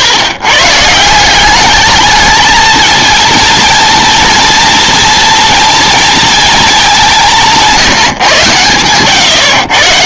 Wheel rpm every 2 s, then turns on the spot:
150, 220, 230, 200, 120.
none